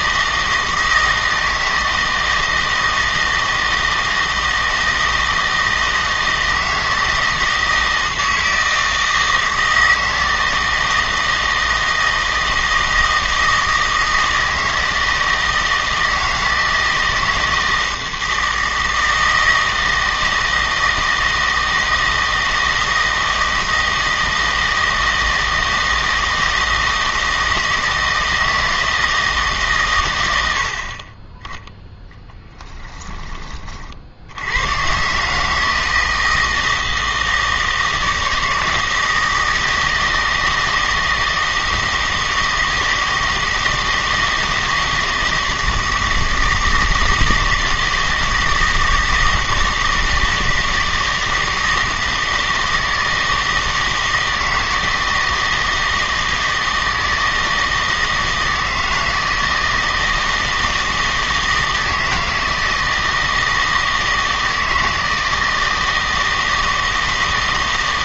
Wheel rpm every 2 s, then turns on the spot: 160, 160, 160, 160, 160, 160, 160, 160, 160, 160, 160, 160, 160, 160, 160, 60, 20, 120, 160, 160, 160, 160, 160, 160, 160, 160, 160, 160, 160, 160, 160, 160, 160, 160.
none